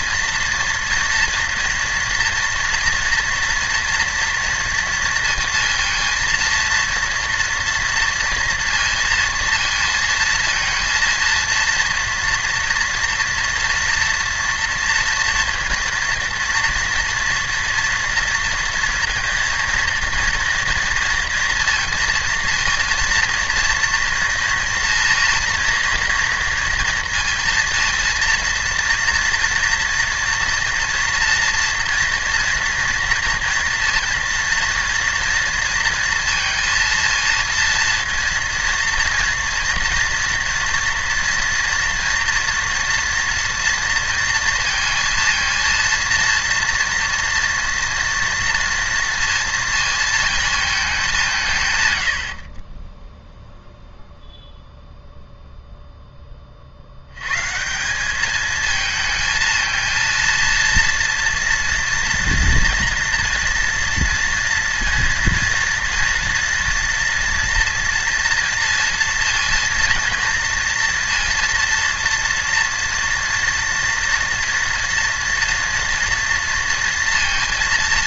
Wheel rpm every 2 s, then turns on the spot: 230, 230, 230, 230, 230, 230, 230, 230, 230, 230, 230, 230, 230, 230, 230, 230, 230, 230, 230, 230, 230, 230, 230, 230, 230, 220, 40, 0, 40, 220, 230, 230, 230, 230, 230, 230, 230, 230, 230.
none